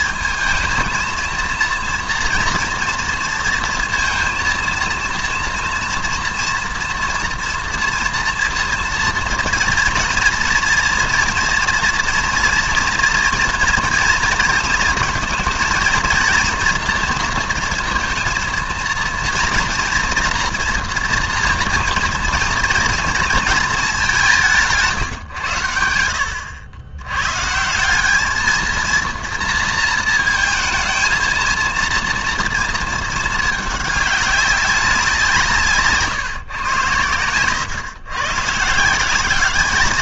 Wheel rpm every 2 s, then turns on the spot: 230, 230, 230, 240, 230, 230, 230, 230, 230, 230, 240, 230, 160, 100, 230, 220, 220, 190, 120, 160.
none